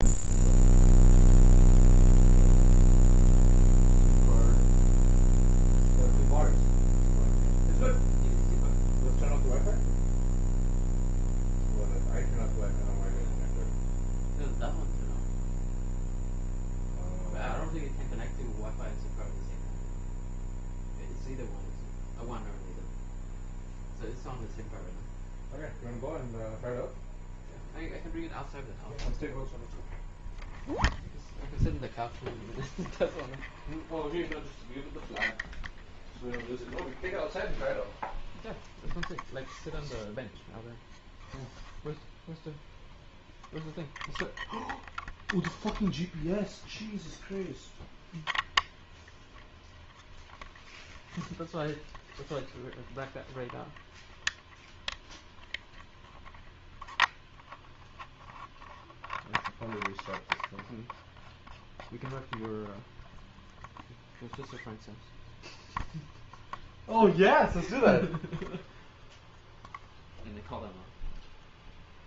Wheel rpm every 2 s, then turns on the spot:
0, 0, 0, 0, 0, 0, 0, 0, 0, 0, 0, 0, 0, 0, 0, 0, 0, 0, 0, 0, 0, 0, 0, 0, 0, 0, 0, 0, 0, 0, 0, 0, 0, 0, 0, 0.
none